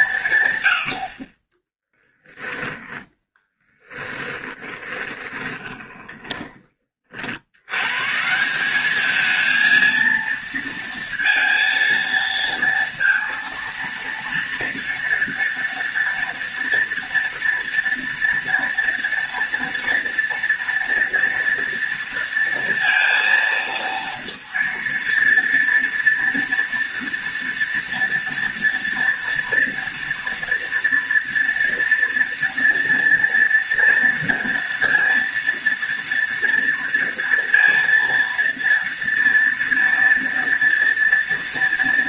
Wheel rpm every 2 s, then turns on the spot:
60, 10, 20, 40, 210, 230, 230, 230, 230, 230, 230, 230, 230, 230, 230, 230, 230, 230, 230, 230, 240.
2-6